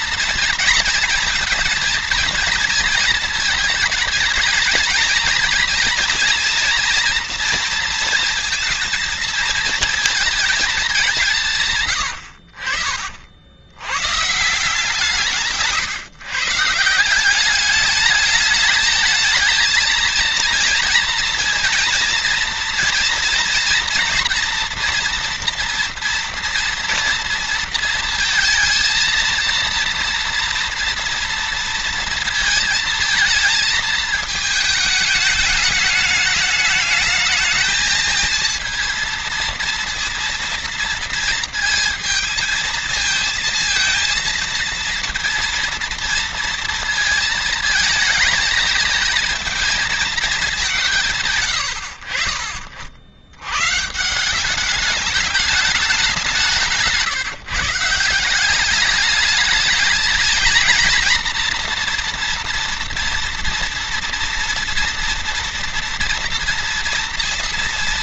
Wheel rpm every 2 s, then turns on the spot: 230, 230, 210, 230, 230, 210, 60, 150, 150, 210, 230, 230, 230, 230, 230, 230, 230, 210, 210, 230, 230, 230, 230, 230, 220, 190, 50, 200, 170, 190, 230, 230, 230, 240.
56-58